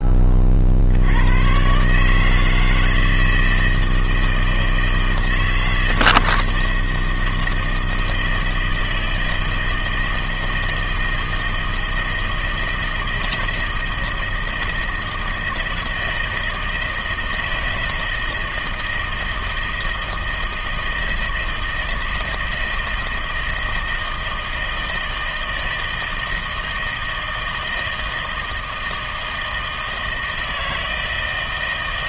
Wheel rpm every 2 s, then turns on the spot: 60, 160, 160, 160, 160, 160, 160, 160, 160, 160, 160, 160, 160, 160, 160, 160.
none